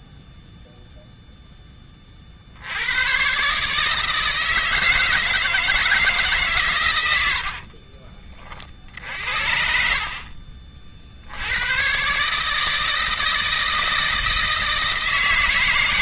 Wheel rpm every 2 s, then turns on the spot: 0, 110, 160, 100, 60, 70, 160, 160.
6-8